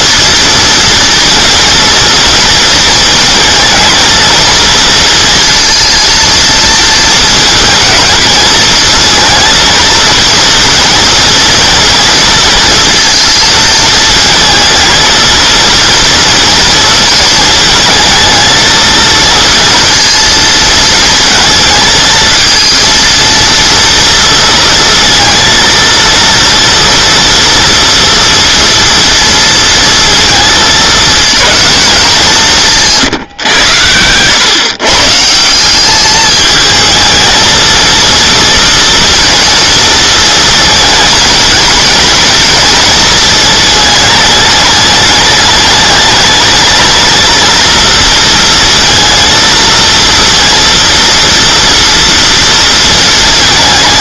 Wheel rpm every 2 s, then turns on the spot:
230, 230, 230, 230, 230, 230, 230, 220, 230, 230, 220, 230, 230, 240, 230, 220, 150, 130, 220, 230, 230, 220, 210, 230, 230, 230, 230.
none